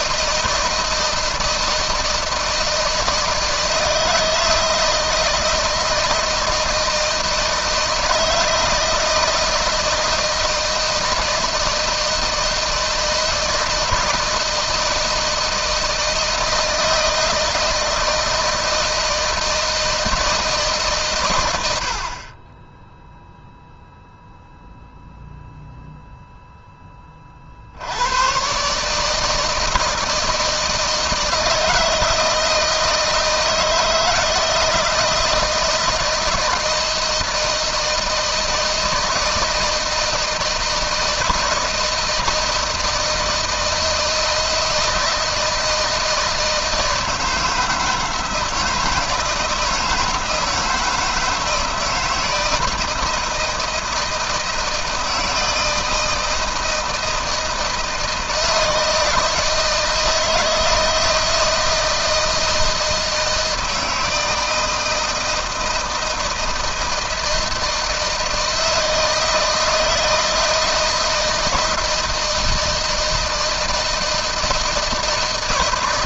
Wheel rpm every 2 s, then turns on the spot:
160, 160, 160, 160, 160, 160, 160, 160, 160, 160, 150, 10, 0, 10, 120, 160, 160, 160, 160, 160, 160, 160, 160, 160, 160, 160, 160, 160, 160, 160, 160, 160, 160, 160, 160, 160, 160, 160.
none